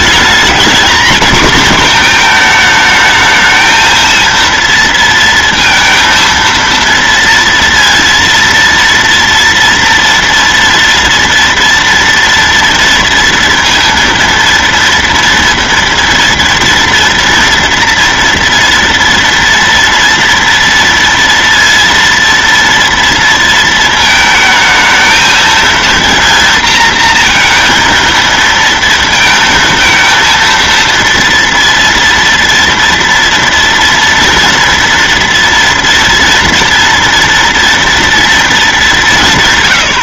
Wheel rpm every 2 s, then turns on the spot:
230, 220, 230, 230, 230, 230, 230, 230, 230, 230, 230, 230, 220, 230, 230, 230, 230, 230, 230, 210.
none